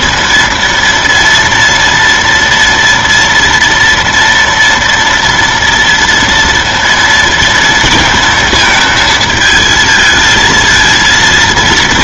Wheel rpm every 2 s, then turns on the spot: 230, 240, 240, 230, 230, 230.
none